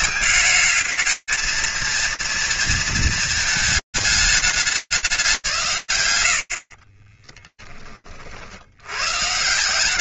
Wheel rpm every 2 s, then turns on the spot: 230, 220, 180, 20, 130.
6-8